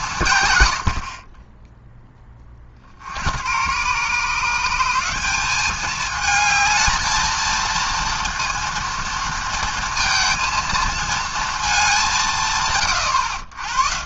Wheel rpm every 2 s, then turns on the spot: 90, 40, 160, 220, 230, 230, 130.
none